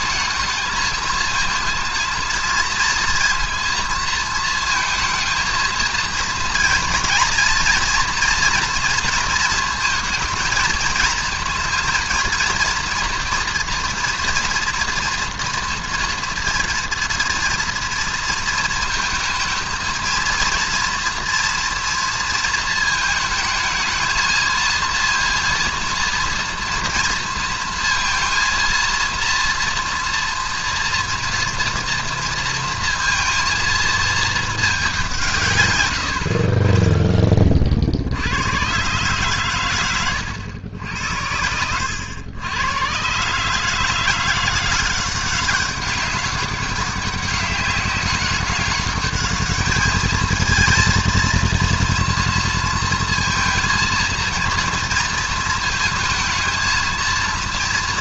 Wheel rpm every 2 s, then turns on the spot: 220, 230, 220, 230, 230, 220, 230, 230, 230, 230, 230, 220, 230, 230, 230, 230, 230, 220, 40, 110, 90, 110, 180, 190, 200, 220, 230, 230, 220.
none